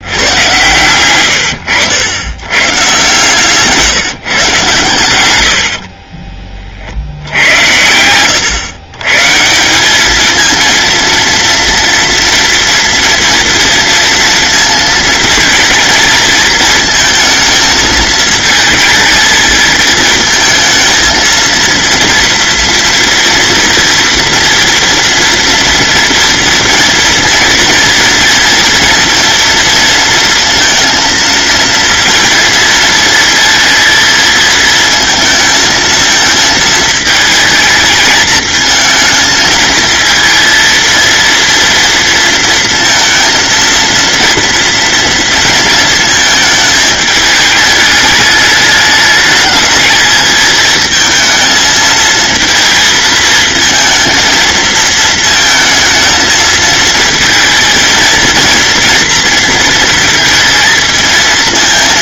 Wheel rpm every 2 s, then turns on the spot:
110, 120, 120, 60, 120, 230, 230, 230, 220, 220, 220, 230, 230, 230, 230, 230, 230, 230, 220, 220, 230, 230, 230, 220, 210, 220, 220, 230, 220, 230, 220.
none